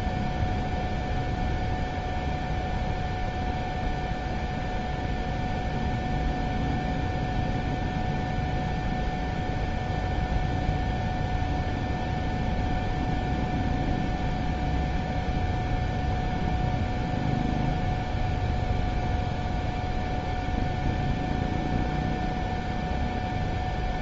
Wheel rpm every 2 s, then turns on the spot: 0, 0, 0, 0, 0, 0, 0, 0, 0, 0, 0, 0.
none